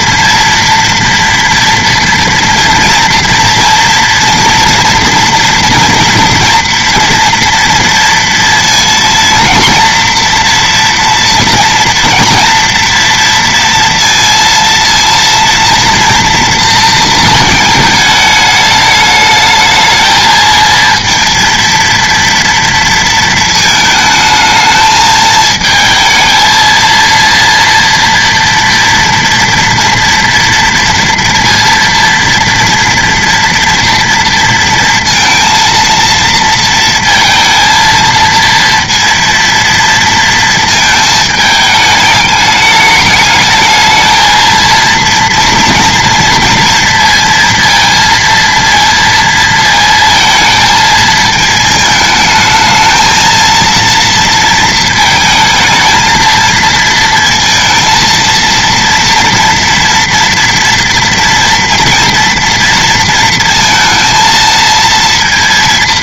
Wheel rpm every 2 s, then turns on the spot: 230, 230, 230, 240, 230, 230, 230, 230, 220, 210, 230, 230, 220, 230, 230, 230, 230, 230, 230, 230, 220, 210, 230, 230, 230, 220, 220, 220, 230, 230, 230, 230, 230.
none